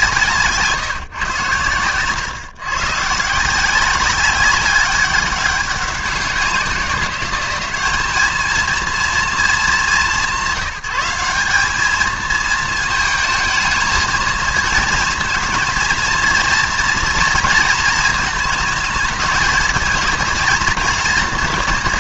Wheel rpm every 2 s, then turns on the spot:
140, 130, 200, 190, 230, 180, 220, 230, 230, 220, 230.
none